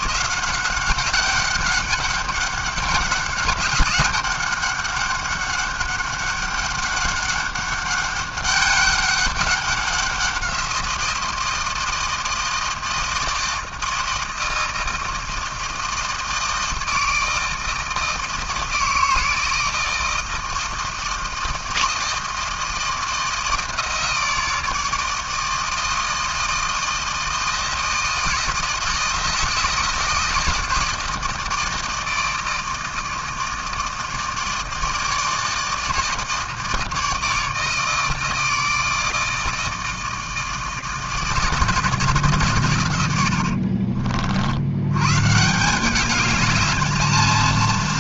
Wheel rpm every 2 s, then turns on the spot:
180, 190, 200, 200, 200, 180, 160, 160, 160, 160, 160, 160, 160, 160, 160, 160, 160, 160, 160, 160, 160, 130, 60, 210.
none